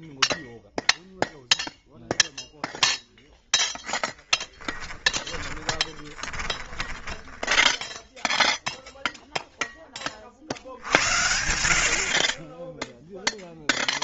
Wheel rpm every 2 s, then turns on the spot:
0, 0, 10, 20, 0, 60, 10.
4-8